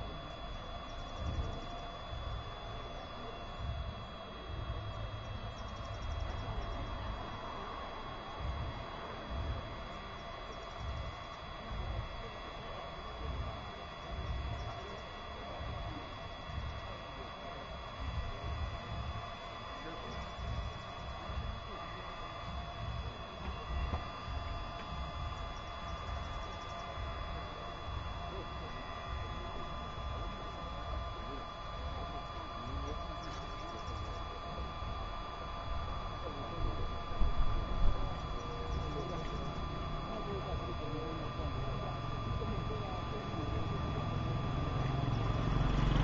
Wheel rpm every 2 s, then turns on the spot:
0, 0, 0, 0, 0, 0, 0, 0, 0, 0, 0, 0, 0, 0, 0, 0, 0, 0, 0, 0, 0, 0, 0.
none